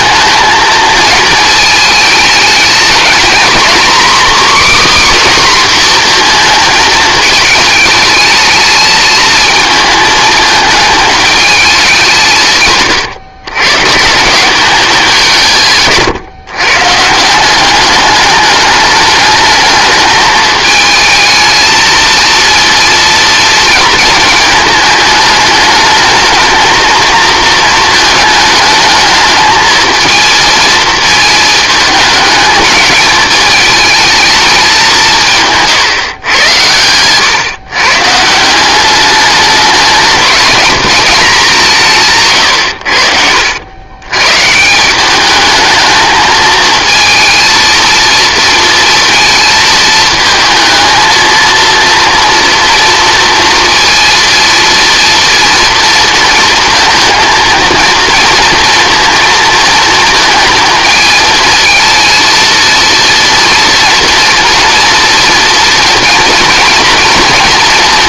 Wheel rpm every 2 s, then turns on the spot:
220, 220, 300, 220, 220, 220, 130, 190, 130, 210, 220, 230, 220, 230, 220, 230, 210, 190, 100, 190, 210, 100, 170, 220, 230, 220, 230, 230, 230, 230, 230, 230, 230, 230.
42-44